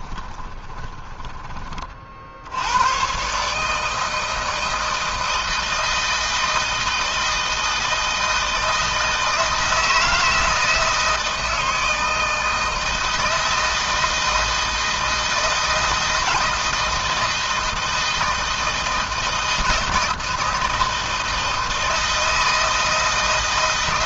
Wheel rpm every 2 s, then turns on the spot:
20, 110, 160, 160, 160, 160, 160, 160, 160, 160, 160, 160.
0-2